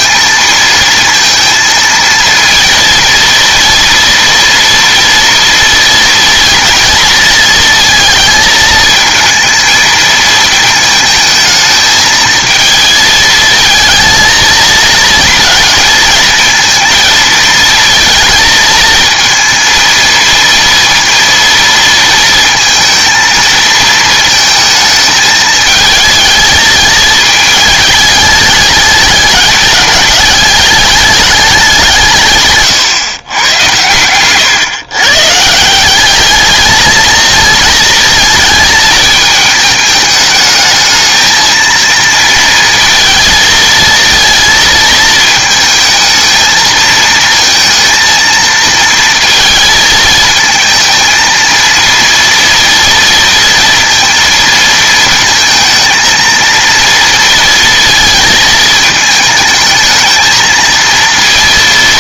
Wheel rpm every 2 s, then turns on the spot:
230, 230, 230, 230, 220, 220, 220, 230, 230, 220, 230, 230, 220, 220, 210, 200, 130, 130, 220, 220, 220, 230, 230, 220, 230, 220, 230, 230, 230, 220, 230.
32-34